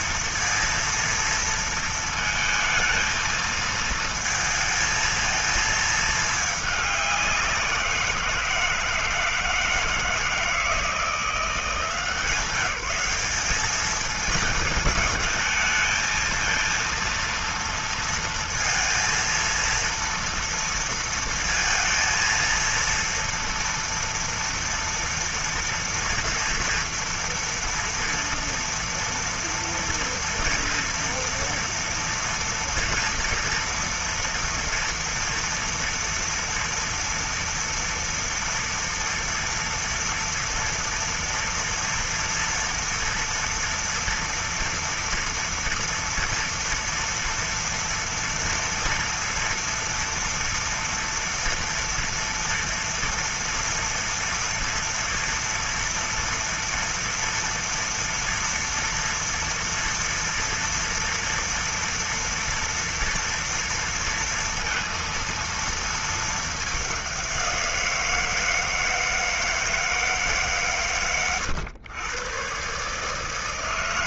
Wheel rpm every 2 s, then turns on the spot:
230, 220, 220, 200, 160, 160, 180, 220, 230, 230, 230, 230, 230, 240, 240, 240, 230, 230, 230, 230, 230, 230, 230, 230, 230, 230, 230, 230, 230, 240, 230, 230, 230, 200, 160, 120, 130.
none